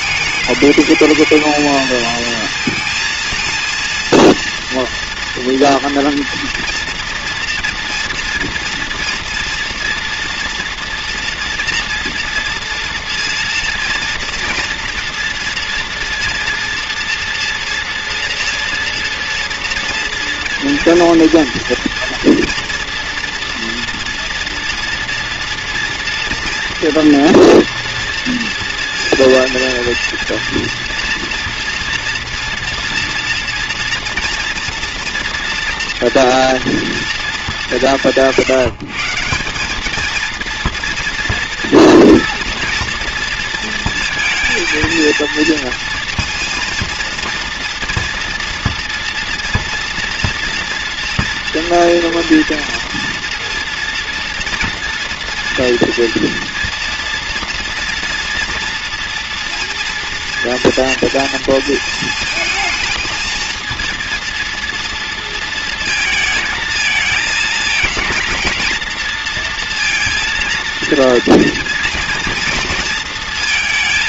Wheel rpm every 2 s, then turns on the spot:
220, 230, 230, 240, 230, 240, 230, 230, 240, 230, 230, 240, 230, 230, 230, 230, 230, 230, 230, 170, 230, 230, 220, 230, 240, 240, 230, 230, 230, 240, 240, 230, 230, 230, 230, 230, 230.
none